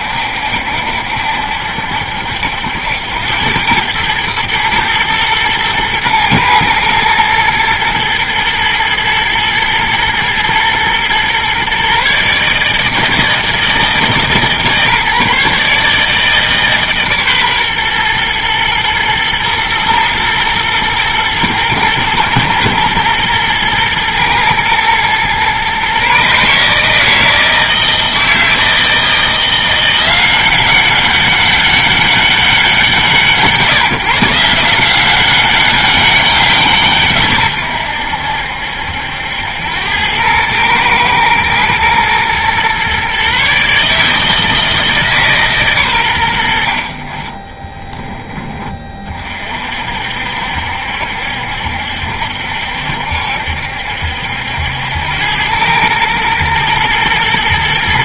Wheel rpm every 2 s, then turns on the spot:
70, 80, 110, 110, 110, 110, 150, 150, 150, 120, 110, 120, 110, 150, 160, 190, 180, 170, 160, 80, 110, 120, 160, 70, 20, 70, 70, 80, 120.
none